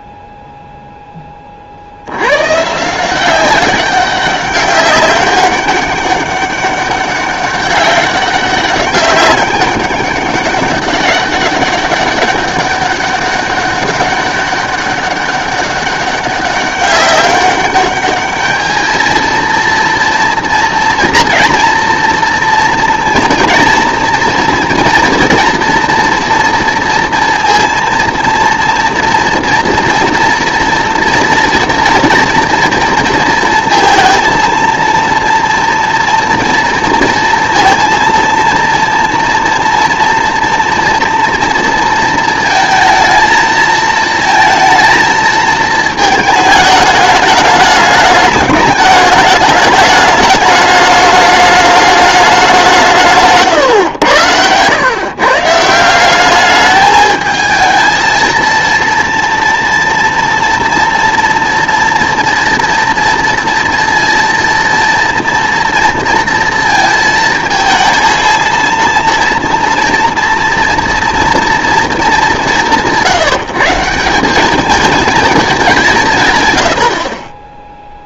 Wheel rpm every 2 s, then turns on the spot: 0, 130, 200, 200, 200, 190, 200, 200, 200, 220, 230, 230, 230, 230, 230, 230, 240, 230, 230, 230, 230, 220, 220, 220, 210, 210, 180, 110, 210, 230, 240, 230, 230, 230, 230, 230, 180, 220, 100.
none